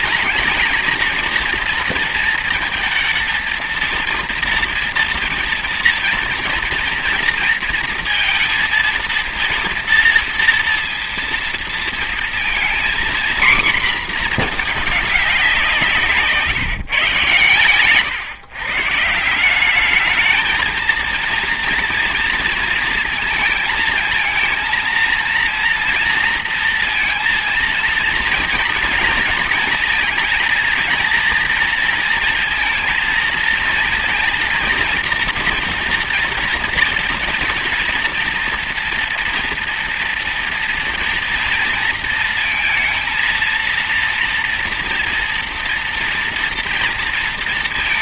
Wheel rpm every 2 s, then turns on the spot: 230, 220, 230, 240, 230, 230, 240, 220, 140, 140, 230, 230, 220, 230, 230, 230, 230, 230, 230, 230, 230, 230, 230, 230.
none